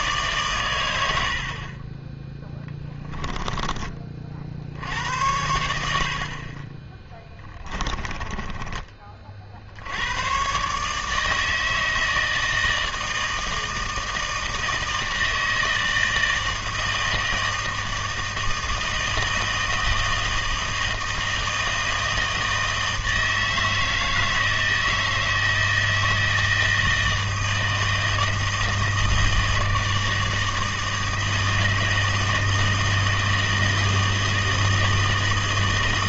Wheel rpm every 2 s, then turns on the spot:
100, 10, 70, 20, 30, 140, 160, 160, 160, 160, 160, 160, 160, 160, 160, 160, 160, 160.
2-4